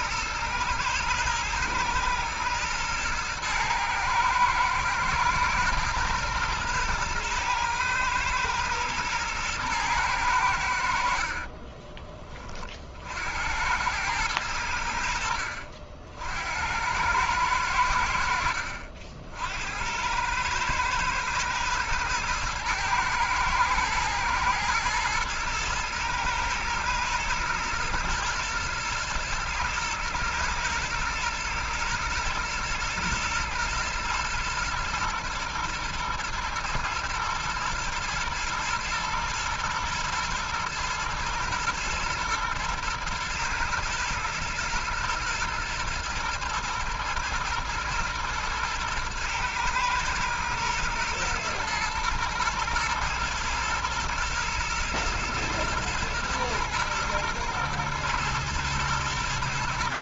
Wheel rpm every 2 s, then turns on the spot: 110, 110, 110, 110, 110, 50, 70, 70, 100, 60, 110, 110, 110, 110, 110, 110, 110, 120, 120, 120, 110, 110, 120, 120, 120, 110, 110, 120, 120, 120.
10-12